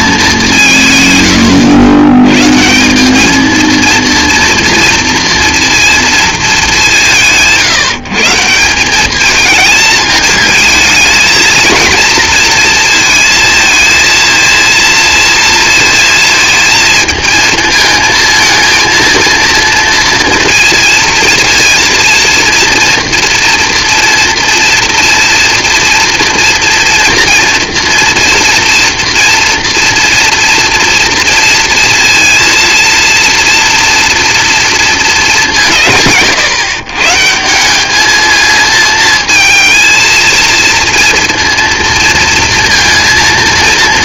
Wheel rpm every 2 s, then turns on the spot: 140, 190, 230, 180, 190, 220, 230, 230, 220, 230, 230, 230, 230, 230, 230, 230, 230, 220, 150, 220, 230, 230.
none